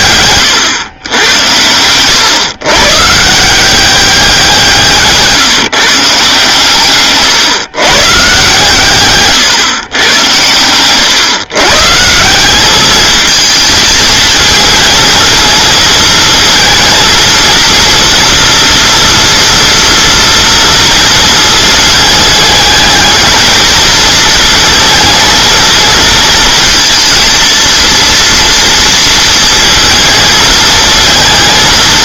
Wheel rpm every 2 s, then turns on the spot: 120, 130, 170, 140, 140, 110, 200, 220, 230, 230, 230, 220, 220, 230, 230, 220.
none